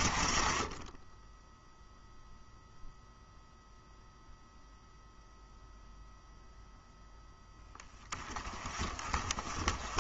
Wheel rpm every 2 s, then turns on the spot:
20, 0, 0, 0, 30.
none